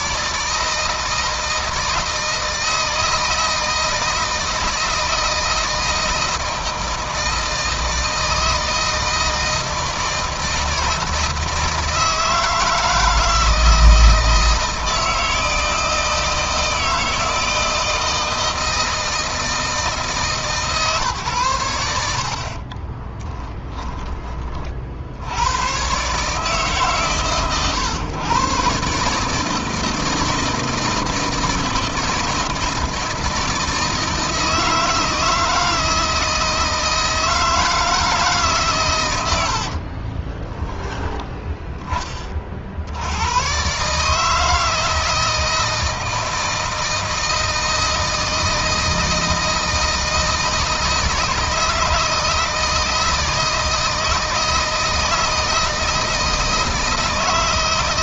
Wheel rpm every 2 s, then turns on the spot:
160, 160, 160, 160, 160, 160, 160, 160, 160, 160, 150, 40, 50, 140, 130, 160, 160, 160, 160, 130, 10, 60, 160, 160, 160, 160, 160, 160, 160.
22-24